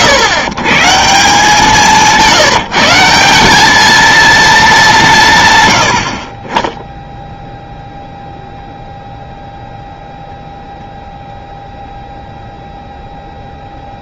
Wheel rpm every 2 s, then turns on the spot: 160, 170, 210, 10, 0, 0, 0.
none